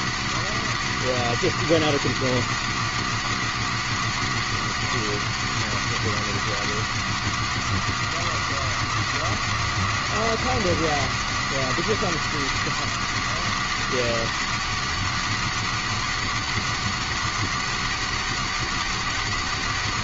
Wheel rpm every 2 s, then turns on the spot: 270, 270, 270, 260, 260, 260, 270, 270, 270, 270.
none